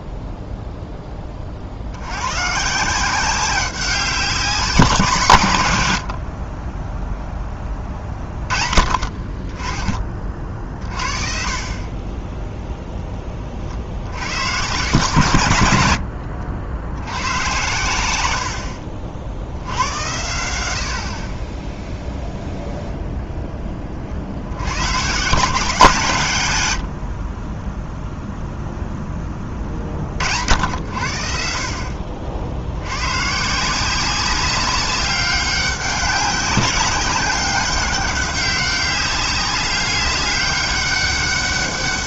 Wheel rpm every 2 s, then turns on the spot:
0, 140, 180, 20, 30, 30, 10, 120, 80, 80, 90, 0, 80, 130, 0, 60, 70, 190, 190, 200, 200.
none